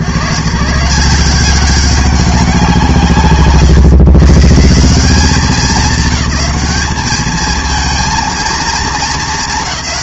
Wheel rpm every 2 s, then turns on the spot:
130, 170, 180, 200, 230.
none